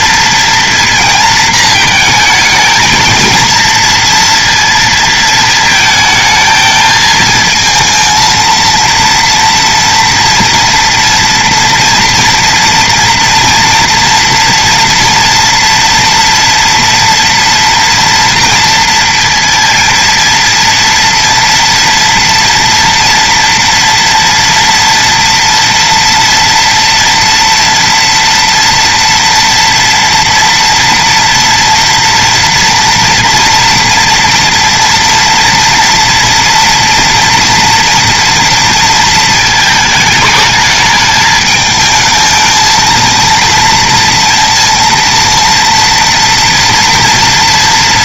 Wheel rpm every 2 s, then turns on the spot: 230, 220, 230, 220, 230, 230, 230, 240, 230, 230, 230, 230, 230, 230, 230, 230, 230, 230, 230, 240, 210, 220, 230, 230.
none